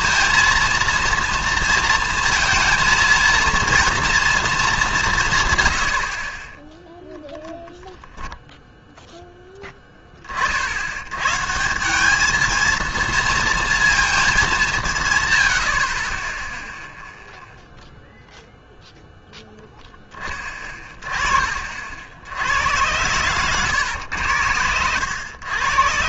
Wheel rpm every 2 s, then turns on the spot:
230, 230, 220, 10, 0, 50, 230, 180, 0, 0, 30, 90, 90.
none